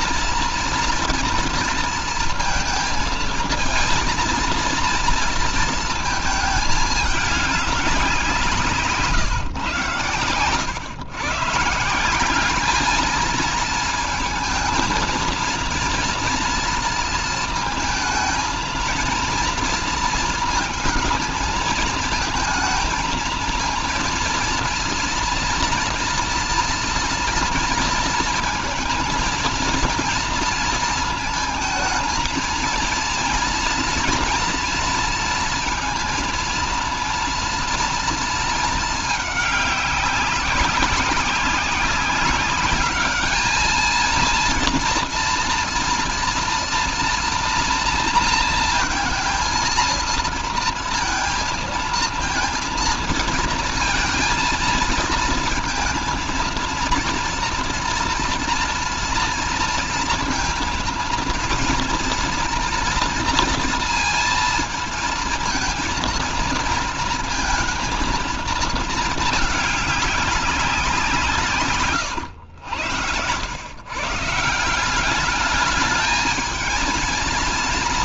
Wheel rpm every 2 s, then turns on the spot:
230, 220, 230, 210, 160, 120, 210, 230, 230, 230, 230, 220, 230, 230, 230, 230, 230, 230, 230, 220, 190, 200, 230, 230, 230, 230, 230, 230, 230, 240, 230, 240, 230, 230, 220, 190, 100, 170, 220.
none